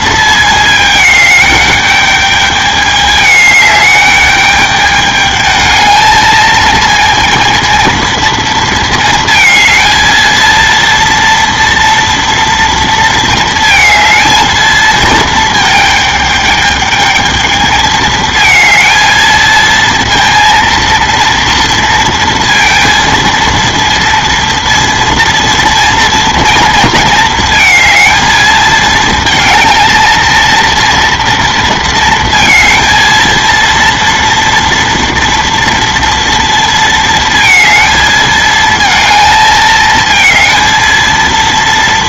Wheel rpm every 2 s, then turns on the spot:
220, 210, 210, 220, 220, 230, 230, 220, 210, 220, 230, 230, 230, 230, 220, 230, 230, 230, 230, 220, 220.
none